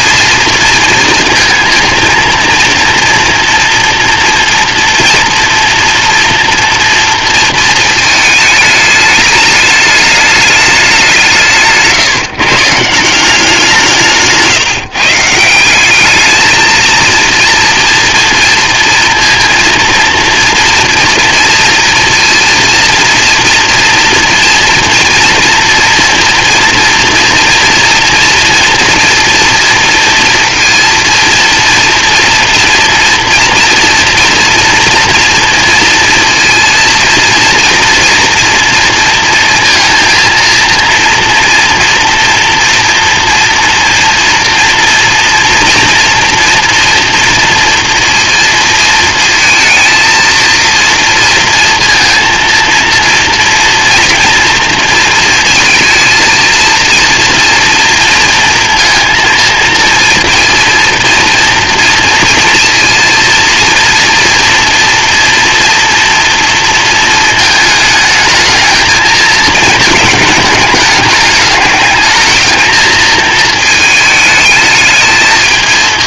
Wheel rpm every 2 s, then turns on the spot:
230, 230, 230, 230, 210, 200, 150, 150, 220, 230, 230, 230, 230, 230, 230, 230, 240, 230, 230, 230, 230, 230, 230, 230, 230, 230, 230, 230, 230, 230, 230, 230, 230, 230, 220, 210, 220, 220.
none